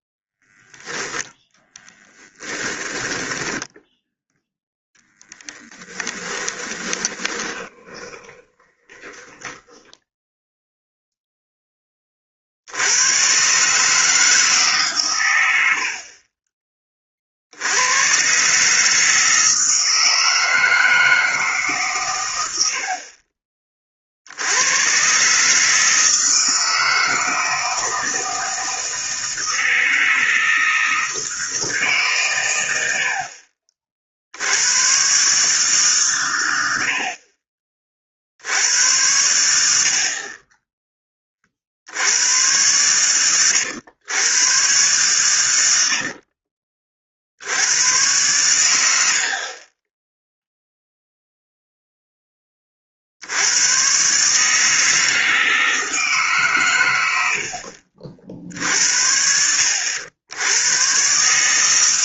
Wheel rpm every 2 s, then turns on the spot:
10, 10, 10, 20, 30, 0, 70, 150, 30, 140, 160, 80, 100, 160, 160, 160, 100, 90, 90, 80, 20, 110, 120, 40, 100, 0, 30, 150, 130, 60, 100.
2-4 6-10 46-48